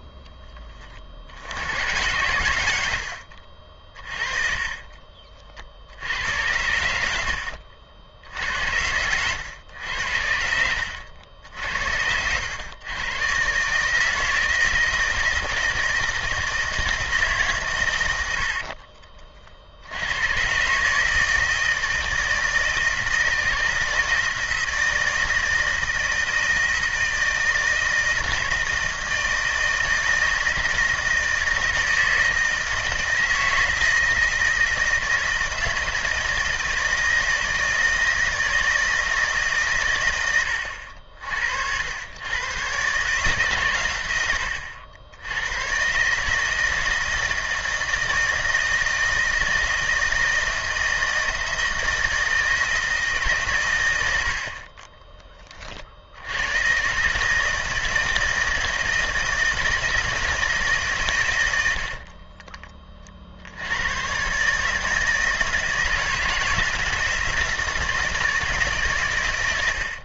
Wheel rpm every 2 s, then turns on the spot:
30, 90, 30, 80, 80, 70, 110, 170, 160, 70, 130, 160, 160, 160, 160, 160, 160, 160, 160, 160, 80, 120, 90, 160, 160, 160, 160, 40, 120, 160, 150, 20, 150, 160, 150.
4-6 8-12 18-20 54-56